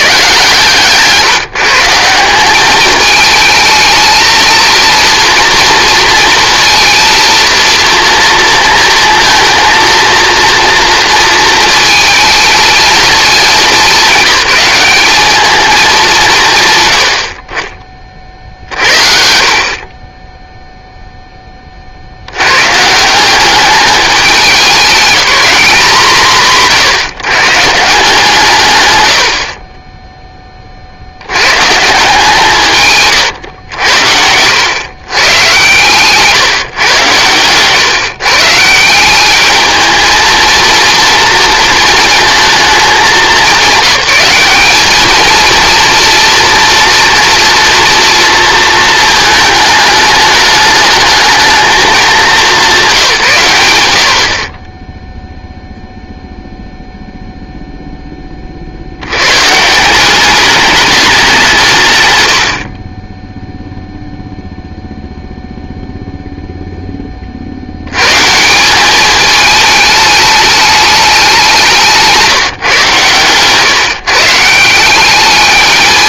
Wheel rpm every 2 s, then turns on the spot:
150, 210, 230, 230, 230, 230, 220, 200, 100, 50, 0, 140, 200, 130, 120, 50, 150, 120, 140, 160, 230, 200, 200, 230, 220, 210, 170, 10, 0, 40, 210, 40, 0, 10, 190, 210, 140, 190.
none